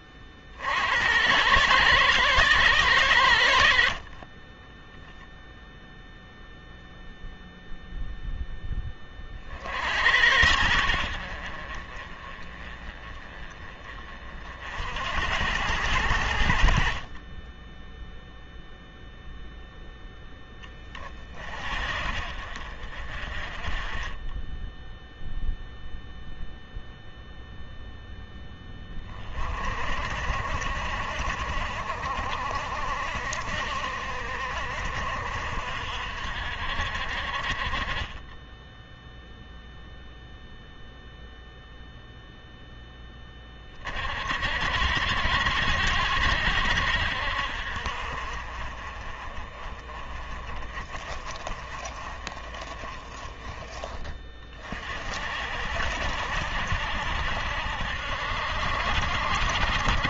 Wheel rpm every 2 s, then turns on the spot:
40, 110, 10, 0, 10, 70, 30, 60, 50, 0, 30, 40, 10, 0, 10, 50, 50, 50, 50, 10, 0, 0, 60, 60, 40, 30, 30, 40, 70, 70.
none